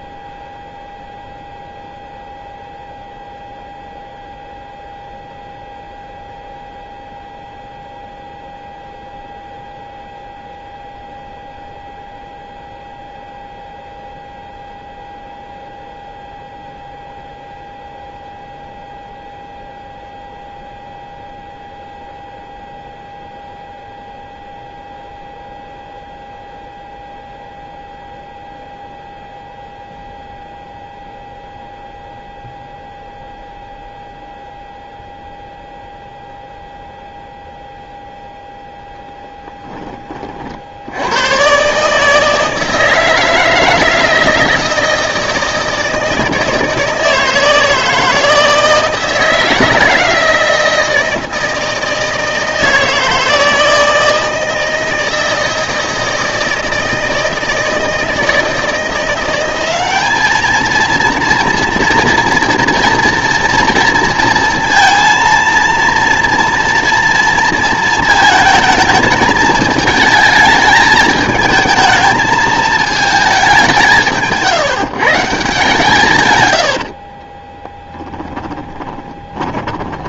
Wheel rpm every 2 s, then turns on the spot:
0, 0, 0, 0, 0, 0, 0, 0, 0, 0, 0, 0, 0, 0, 0, 0, 0, 0, 0, 10, 70, 160, 160, 160, 160, 160, 160, 160, 160, 160, 220, 230, 230, 230, 220, 220, 220, 160, 90, 20.
76-80